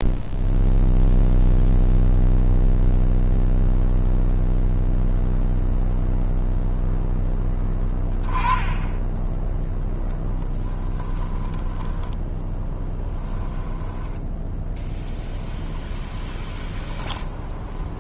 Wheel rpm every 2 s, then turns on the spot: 0, 0, 0, 0, 20, 20, 10, 10, 20.
8-14 16-18